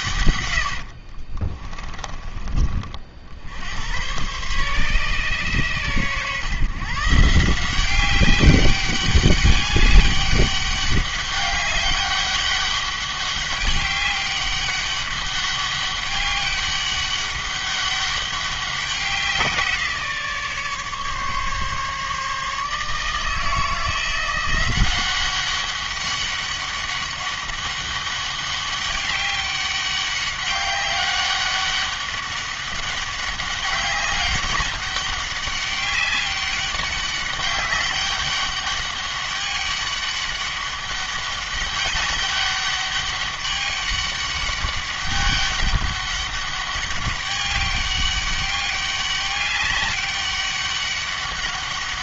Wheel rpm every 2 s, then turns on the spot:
80, 50, 130, 140, 200, 200, 200, 200, 200, 190, 150, 150, 180, 200, 200, 200, 200, 200, 200, 200, 200, 200, 200, 200, 200, 200.
0-2